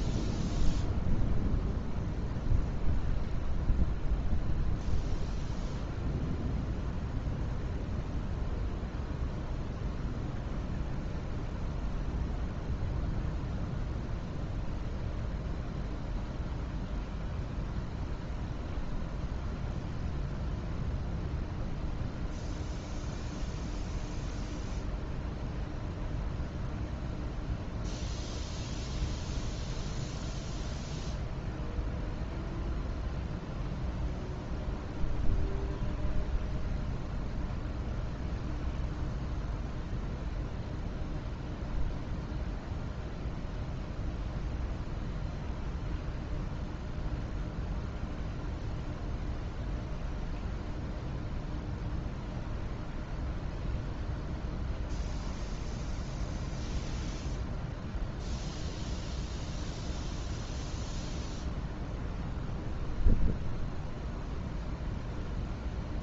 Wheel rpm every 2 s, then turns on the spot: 0, 0, 0, 0, 0, 0, 0, 0, 0, 0, 0, 0, 0, 0, 0, 0, 0, 0, 0, 0, 0, 0, 0, 0, 0, 0, 0, 0, 0, 0, 0, 0, 0.
none